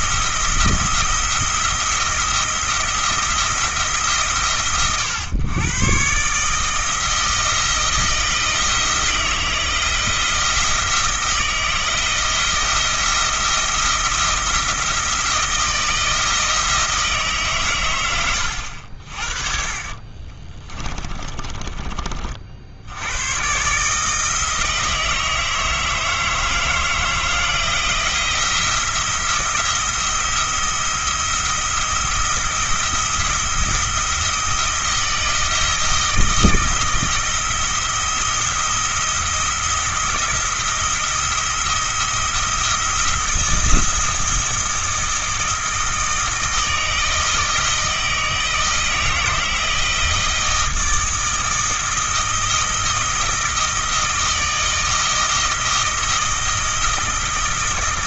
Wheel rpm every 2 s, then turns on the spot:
170, 170, 130, 160, 160, 170, 170, 170, 160, 70, 20, 80, 160, 160, 170, 170, 170, 170, 160, 170, 170, 170, 170, 160, 160, 160, 160, 160, 160.
20-22